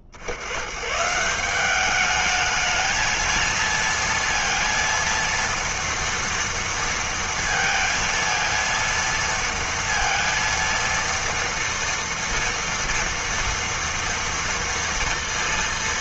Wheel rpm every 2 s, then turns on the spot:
50, 220, 230, 230, 230, 230, 240, 230.
none